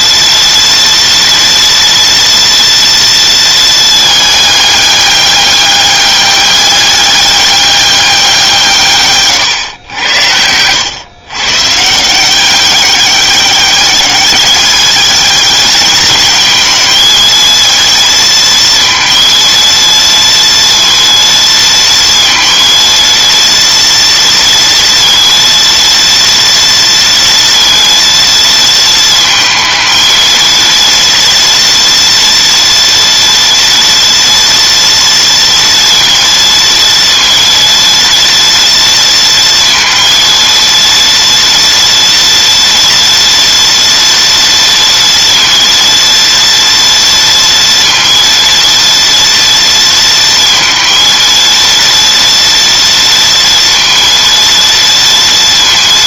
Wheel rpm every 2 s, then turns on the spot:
230, 230, 200, 200, 150, 110, 190, 210, 220, 230, 230, 230, 230, 230, 230, 230, 240, 230, 230, 230, 230, 230, 230, 230, 230, 230, 230, 230.
none